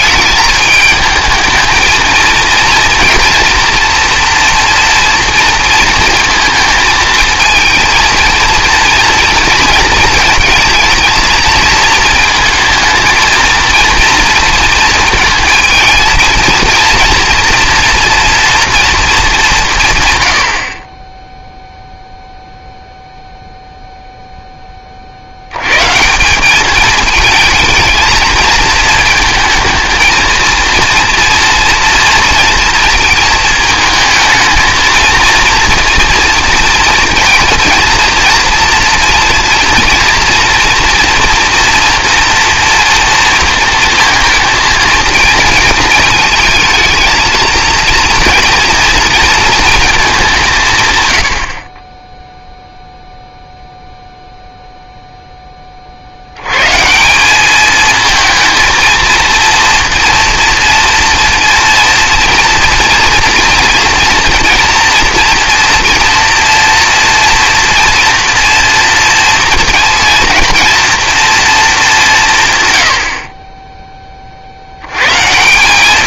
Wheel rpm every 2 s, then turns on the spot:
220, 230, 240, 220, 230, 230, 220, 230, 230, 230, 40, 0, 20, 200, 220, 230, 230, 220, 230, 230, 230, 240, 230, 220, 230, 150, 0, 0, 130, 230, 230, 230, 230, 230, 230, 230, 120, 90.
none